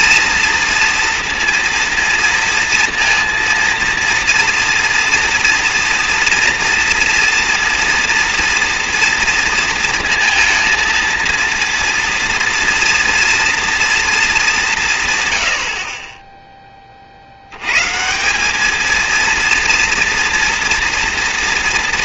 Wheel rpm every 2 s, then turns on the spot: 230, 230, 230, 230, 230, 220, 240, 190, 10, 210, 230.
none